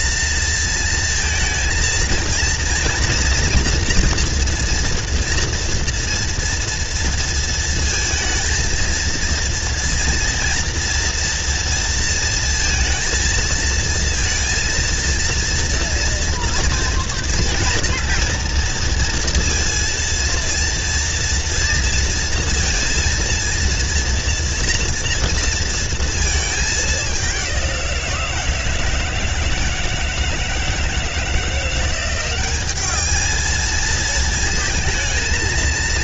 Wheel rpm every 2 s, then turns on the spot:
230, 230, 230, 230, 230, 240, 230, 230, 230, 230, 230, 230, 230, 210, 170, 170, 200, 230.
none